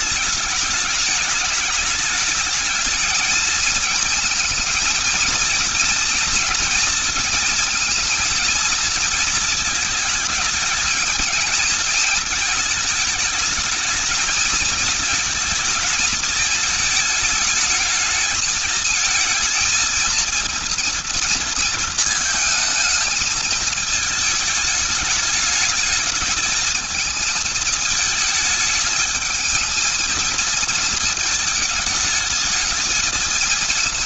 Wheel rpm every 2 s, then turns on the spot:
210, 220, 220, 230, 230, 220, 220, 220, 220, 220, 230, 220, 220, 220, 210, 220, 220.
none